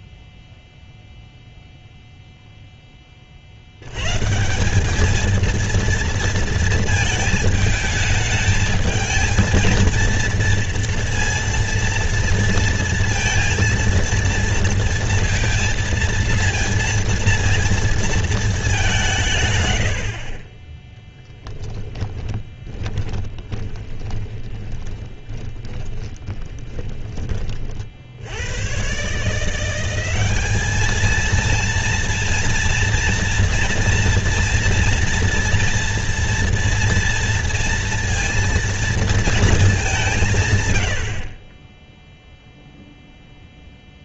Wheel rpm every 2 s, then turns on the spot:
0, 10, 190, 220, 220, 230, 230, 230, 230, 210, 30, 20, 20, 30, 90, 210, 230, 230, 230, 230, 150, 0.
22-28